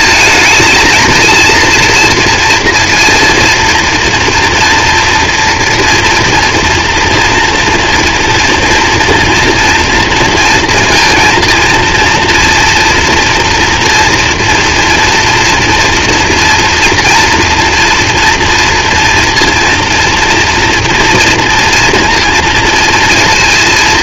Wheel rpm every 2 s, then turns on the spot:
230, 230, 230, 240, 240, 230, 230, 230, 230, 230, 230, 230.
none